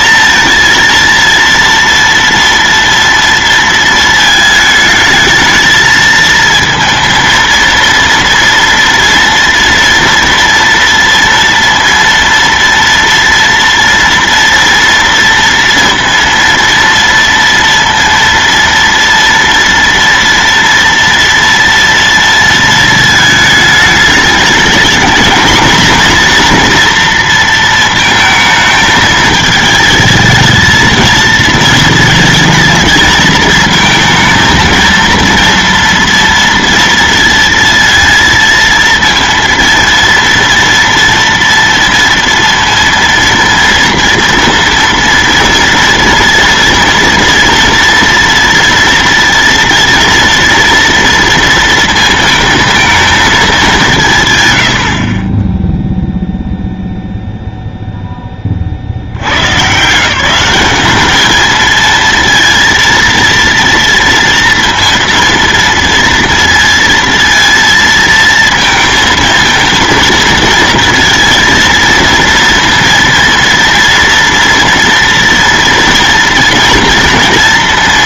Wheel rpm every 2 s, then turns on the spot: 230, 230, 220, 230, 230, 230, 230, 230, 230, 230, 230, 220, 220, 240, 220, 220, 220, 230, 230, 230, 230, 230, 230, 230, 230, 230, 230, 80, 0, 40, 190, 230, 230, 230, 230, 230, 230, 230, 230.
none